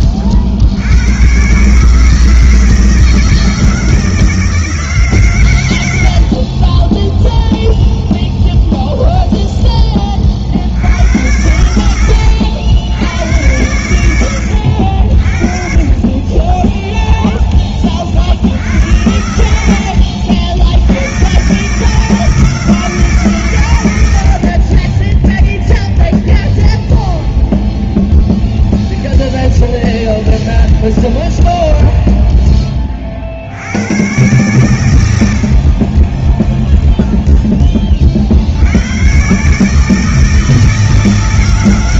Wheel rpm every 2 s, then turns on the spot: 150, 160, 80, 0, 10, 90, 110, 30, 30, 80, 140, 120, 0, 0, 0, 0, 70, 60, 10, 140, 160.
none